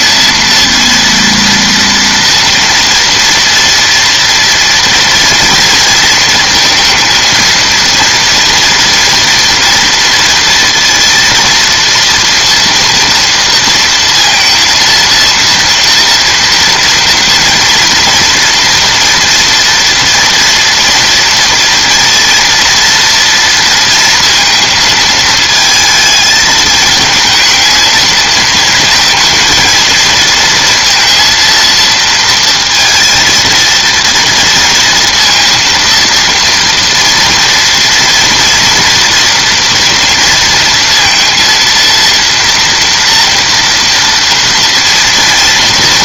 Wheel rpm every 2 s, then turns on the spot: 230, 230, 230, 230, 230, 230, 230, 230, 230, 230, 240, 230, 230, 220, 220, 230, 230, 230, 230, 240, 230, 230, 230.
none